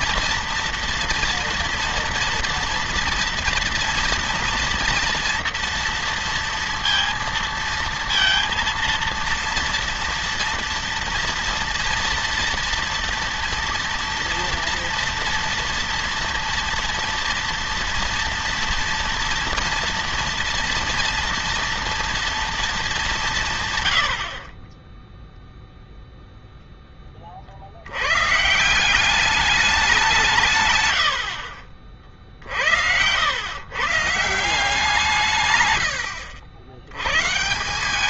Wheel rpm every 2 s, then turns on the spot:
230, 240, 240, 230, 230, 230, 230, 230, 230, 230, 230, 230, 40, 0, 140, 150, 60, 170, 90.
none